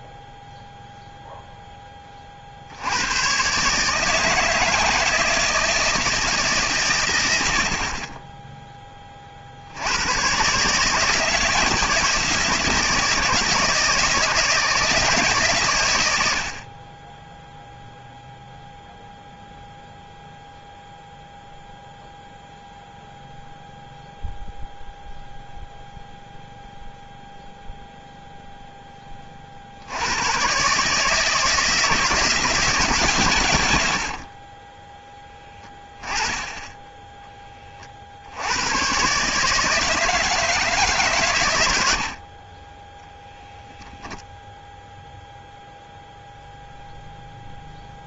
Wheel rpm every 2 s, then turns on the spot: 0, 80, 160, 120, 20, 160, 160, 160, 30, 0, 0, 0, 0, 0, 0, 140, 140, 10, 10, 120, 150, 10, 0, 0.
none